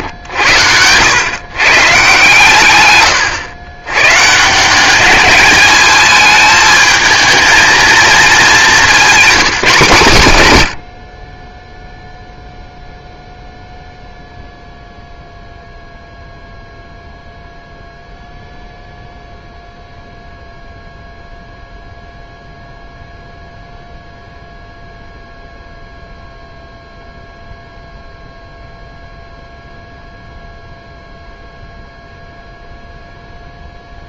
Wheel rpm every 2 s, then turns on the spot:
100, 120, 190, 220, 200, 90, 0, 0, 0, 0, 0, 0, 0, 0, 0, 0, 0.
none